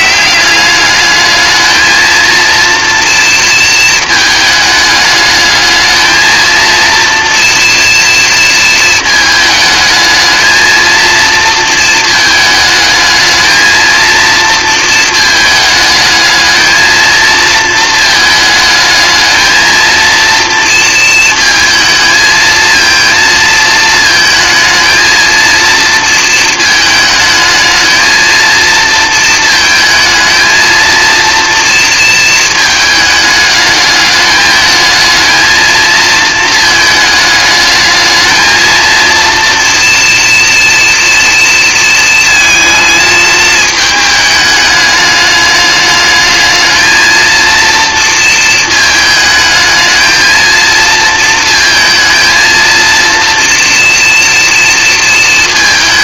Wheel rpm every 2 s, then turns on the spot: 210, 230, 210, 230, 230, 230, 220, 220, 220, 220, 230, 230, 220, 220, 230, 230, 220, 220, 220, 230, 240, 220, 210, 220, 220, 230, 230, 230.
none